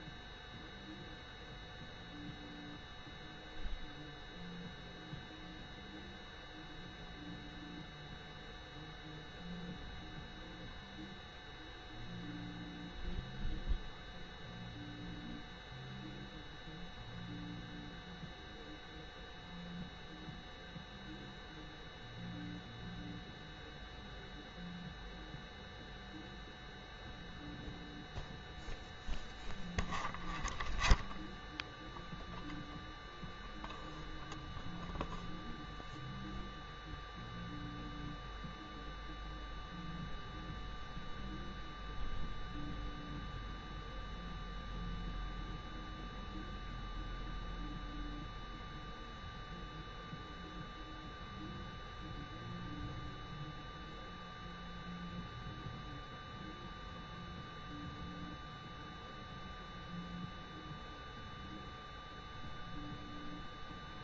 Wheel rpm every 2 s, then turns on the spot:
0, 0, 0, 0, 0, 0, 0, 0, 0, 0, 0, 0, 0, 0, 0, 0, 0, 0, 0, 0, 0, 0, 0, 0, 0, 0, 0, 0, 0, 0, 0, 0.
none